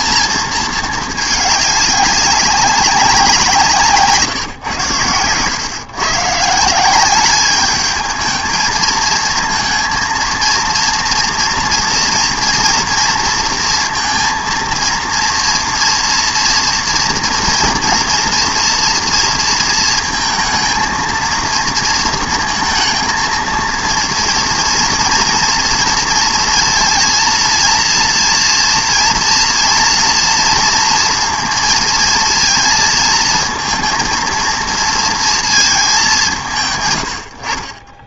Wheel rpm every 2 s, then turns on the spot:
230, 200, 130, 160, 220, 230, 230, 230, 240, 240, 230, 230, 230, 230, 240, 230, 230, 230, 150.
none